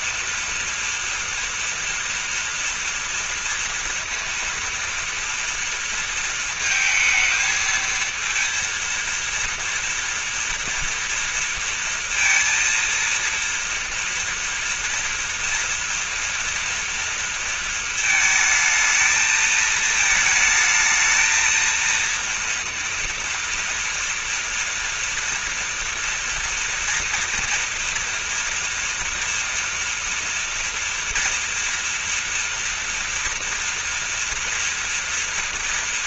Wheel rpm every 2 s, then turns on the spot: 230, 230, 230, 220, 230, 230, 230, 230, 230, 220, 220, 230, 240, 230, 230, 230, 230, 230.
none